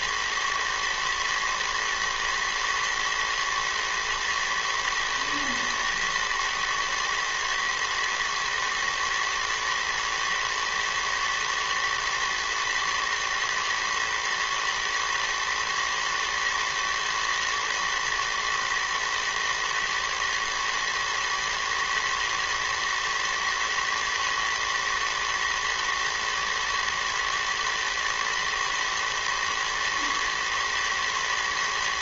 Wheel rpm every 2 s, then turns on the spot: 110, 110, 120, 110, 110, 110, 110, 110, 110, 110, 120, 120, 110, 110, 110, 110.
none